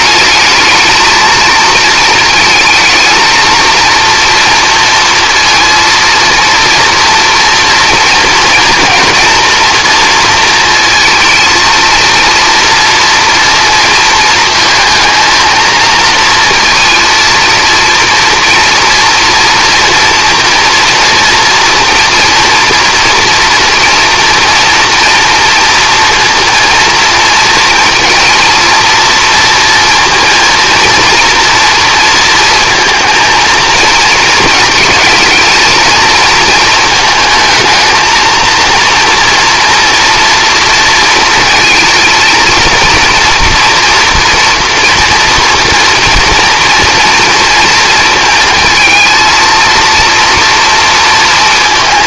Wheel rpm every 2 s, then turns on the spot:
220, 230, 230, 230, 240, 230, 230, 230, 230, 230, 240, 240, 240, 230, 230, 230, 230, 220, 220, 230, 230, 230, 240, 230, 230, 230.
none